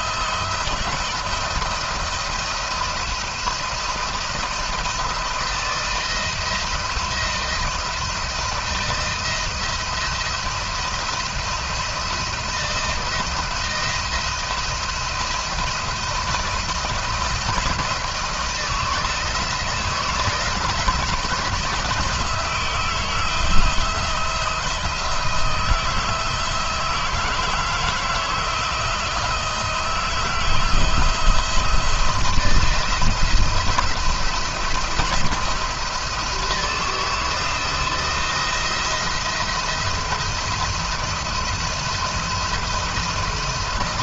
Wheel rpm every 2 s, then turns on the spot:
170, 170, 170, 170, 160, 170, 170, 160, 160, 160, 170, 160, 160, 160, 170, 170, 170, 170, 170, 170, 170, 170.
none